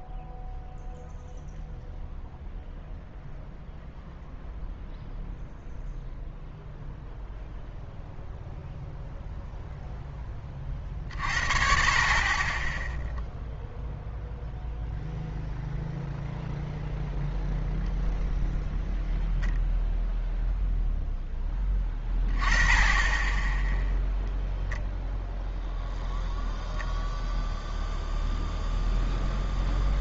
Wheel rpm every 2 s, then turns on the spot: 0, 0, 0, 0, 0, 30, 10, 0, 0, 0, 0, 10, 0, 0, 0.
none